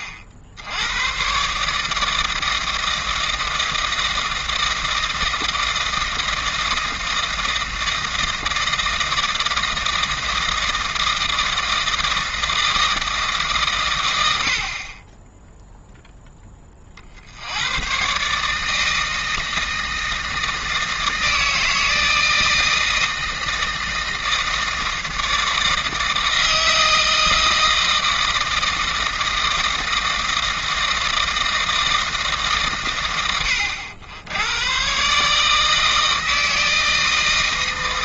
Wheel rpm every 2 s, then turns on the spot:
70, 160, 160, 160, 160, 160, 160, 40, 30, 160, 160, 160, 160, 160, 160, 160, 130, 120, 160.
none